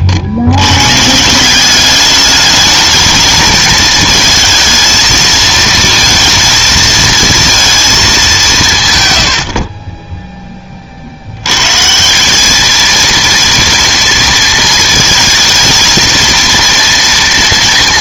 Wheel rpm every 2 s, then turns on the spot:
100, 210, 220, 230, 130, 20, 220, 220, 230.
none